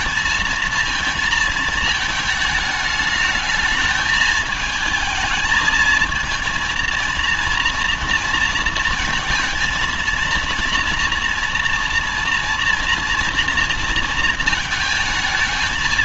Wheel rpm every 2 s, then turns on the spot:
220, 210, 220, 230, 230, 230, 230, 230.
none